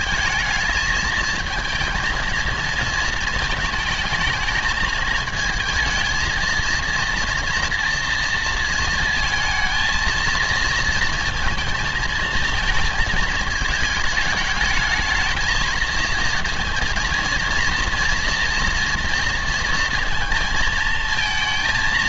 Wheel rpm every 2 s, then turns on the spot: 220, 220, 220, 230, 230, 230, 220, 220, 230, 230, 230.
none